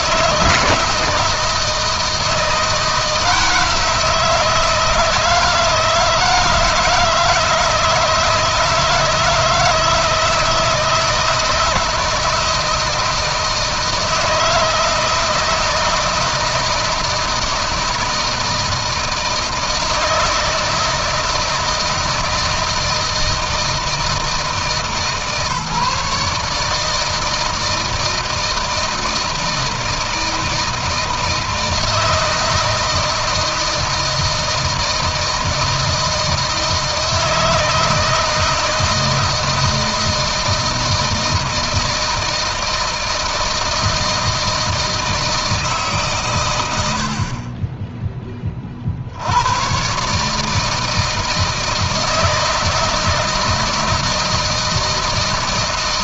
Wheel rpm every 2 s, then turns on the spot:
160, 160, 160, 160, 160, 160, 160, 160, 160, 160, 160, 160, 160, 160, 160, 160, 160, 160, 160, 160, 160, 160, 160, 70, 70, 160, 160, 160.
none